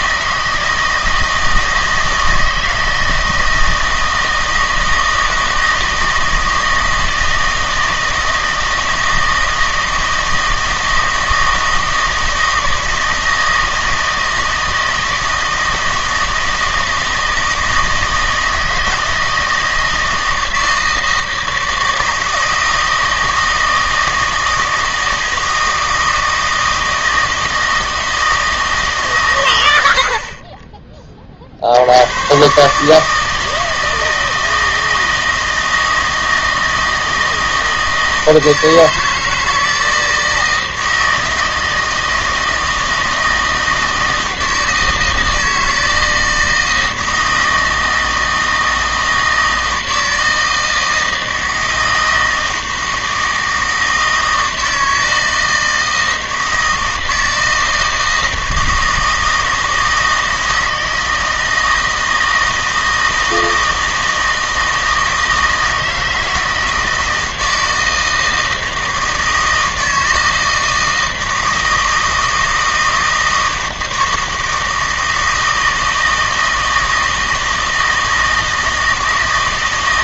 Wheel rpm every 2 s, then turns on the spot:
160, 160, 160, 160, 160, 160, 160, 160, 160, 160, 160, 160, 160, 160, 150, 20, 140, 160, 160, 160, 160, 160, 160, 160, 160, 160, 160, 160, 160, 160, 160, 160, 160, 160, 160, 160, 160, 160, 160, 160.
none